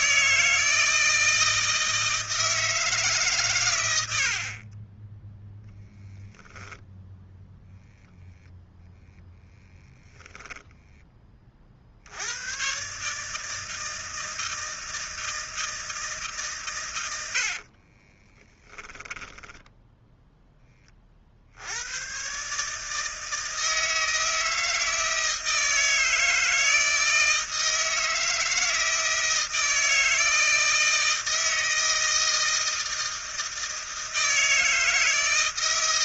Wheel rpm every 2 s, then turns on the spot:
160, 150, 30, 0, 0, 10, 130, 160, 130, 20, 20, 150, 160, 160, 160, 160, 160, 160.
10-12 18-20